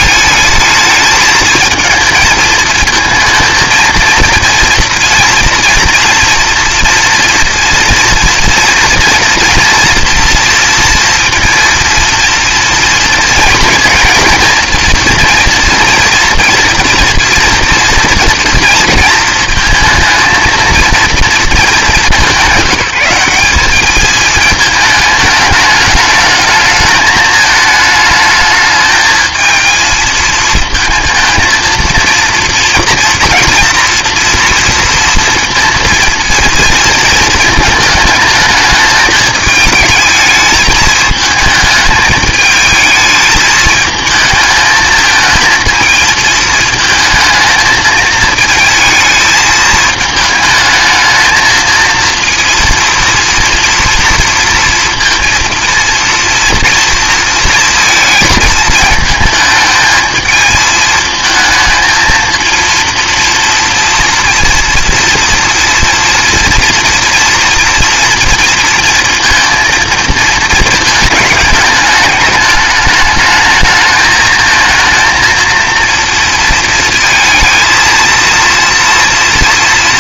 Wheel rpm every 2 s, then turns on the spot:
220, 230, 240, 240, 240, 230, 230, 230, 230, 230, 230, 190, 220, 220, 220, 220, 230, 230, 230, 220, 210, 220, 220, 220, 220, 220, 230, 230, 230, 220, 220, 230, 240, 240, 230, 220, 210, 220, 230, 230.
none